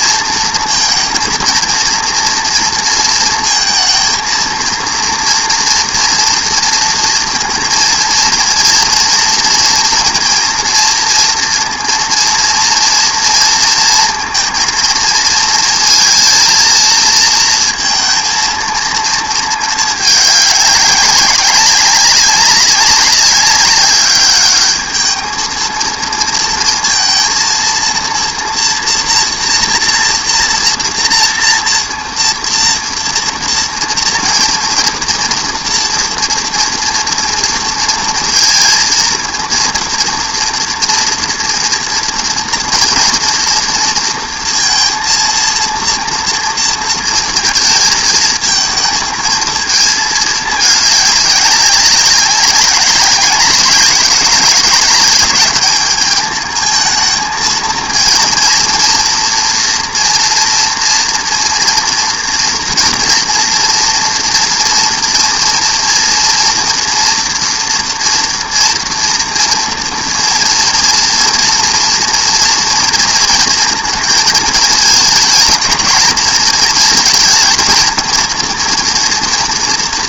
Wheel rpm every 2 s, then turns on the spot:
230, 230, 230, 230, 230, 230, 230, 230, 230, 220, 200, 190, 210, 230, 230, 230, 230, 230, 240, 230, 230, 230, 230, 230, 220, 210, 190, 210, 220, 240, 230, 230, 230, 230, 230, 230, 230, 220, 220, 230.
none